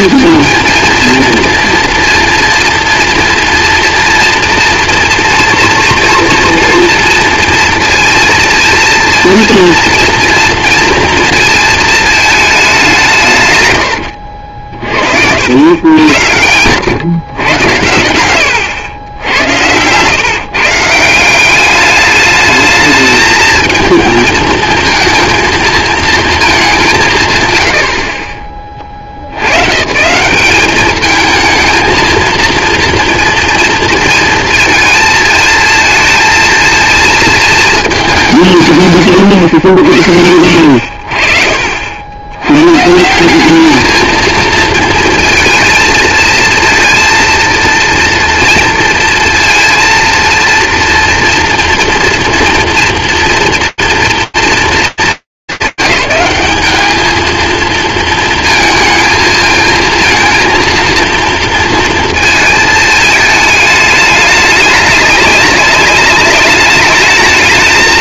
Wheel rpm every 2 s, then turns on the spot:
220, 230, 230, 230, 230, 230, 200, 60, 100, 100, 150, 220, 220, 200, 50, 210, 230, 230, 230, 140, 60, 140, 220, 230, 230, 230, 230, 230, 210, 230, 230, 220, 210, 200.
14-16